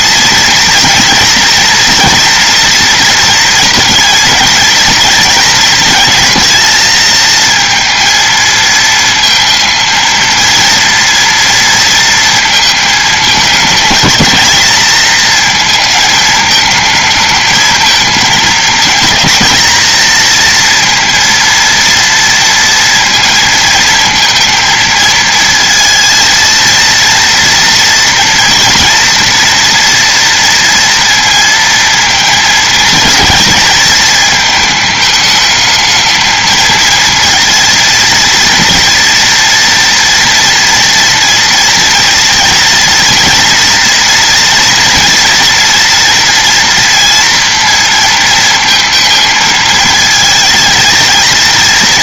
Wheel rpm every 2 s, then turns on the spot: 230, 230, 230, 220, 220, 230, 220, 220, 220, 230, 230, 230, 230, 230, 230, 230, 230, 210, 220, 230, 230, 230, 230, 230, 230, 230.
none